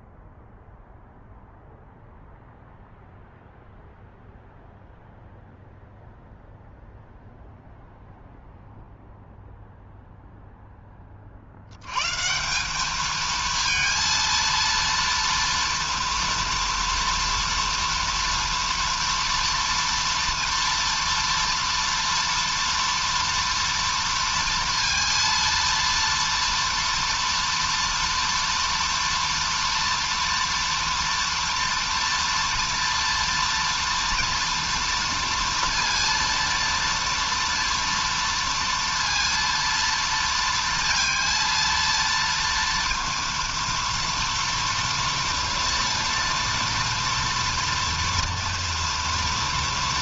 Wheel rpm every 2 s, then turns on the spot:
0, 0, 0, 0, 0, 0, 170, 230, 230, 230, 230, 230, 230, 230, 230, 230, 230, 230, 230, 230, 230, 230, 230, 230, 230.
none